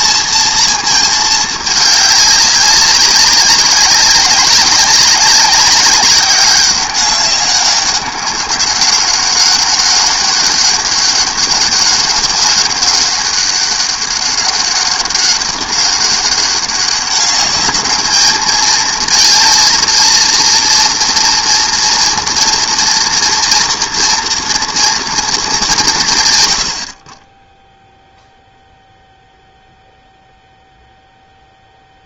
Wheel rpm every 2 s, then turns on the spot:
220, 200, 190, 200, 200, 200, 200, 200, 200, 220, 230, 230, 230, 40, 0, 0.
none